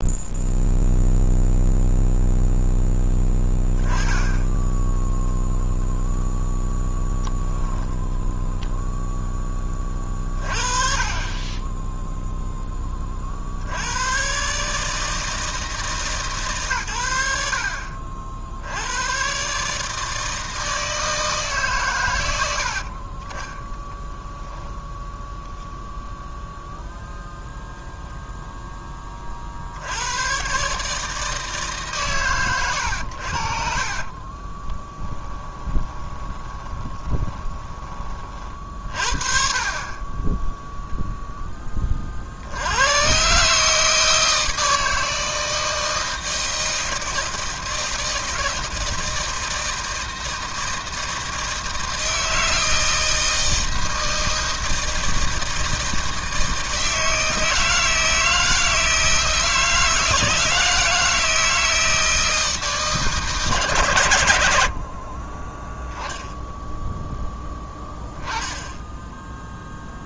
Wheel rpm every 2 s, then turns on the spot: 0, 0, 0, 0, 0, 30, 10, 150, 130, 80, 160, 60, 10, 0, 10, 140, 110, 20, 20, 40, 0, 80, 160, 160, 160, 160, 160, 160, 160, 160, 160, 160, 60, 0, 10.
22-26 34-38 68-70